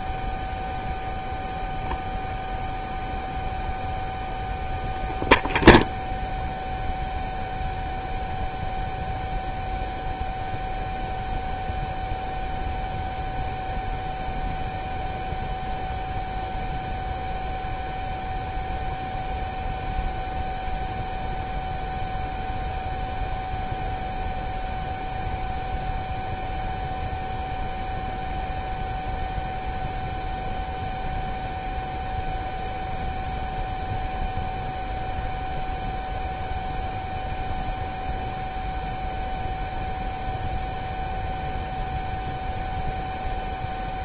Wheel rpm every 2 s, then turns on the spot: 0, 0, 0, 0, 0, 0, 0, 0, 0, 0, 0, 0, 0, 0, 0, 0, 0, 0, 0, 0, 0, 0.
none